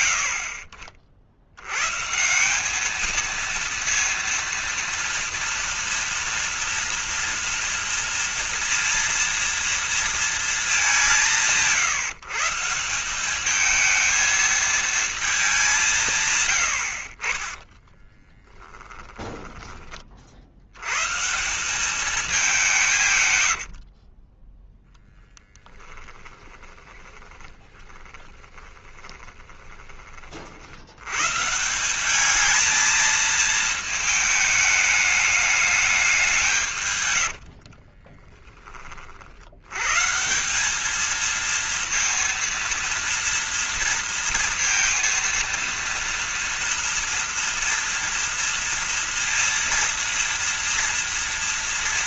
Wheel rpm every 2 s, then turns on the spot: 100, 210, 230, 230, 230, 200, 180, 220, 100, 10, 110, 180, 10, 20, 20, 90, 220, 210, 140, 40, 210, 230, 230, 230, 230, 230.
18-20 24-30